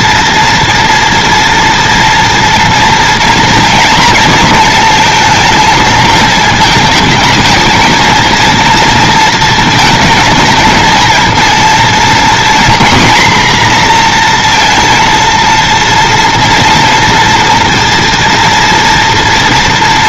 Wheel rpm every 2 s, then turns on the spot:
230, 230, 230, 220, 230, 230, 230, 230, 240, 240.
none